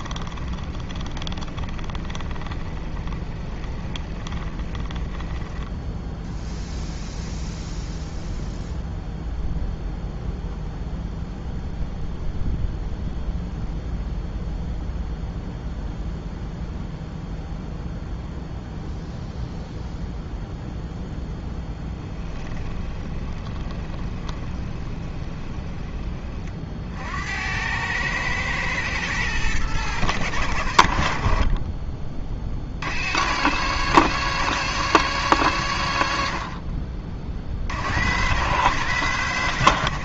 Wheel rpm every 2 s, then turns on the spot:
20, 20, 30, 10, 0, 0, 0, 0, 0, 0, 0, 10, 20, 40, 110, 90, 50, 130, 50, 120.
0-6 22-26